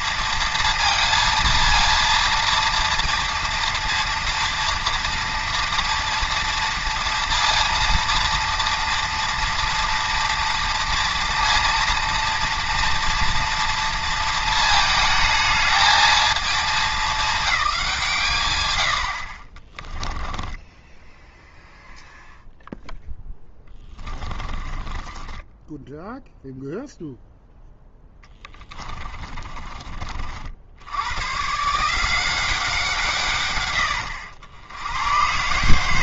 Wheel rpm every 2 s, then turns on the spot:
230, 230, 230, 230, 230, 230, 230, 220, 210, 80, 10, 0, 20, 0, 20, 90, 160, 100.
18-22 24-26 28-30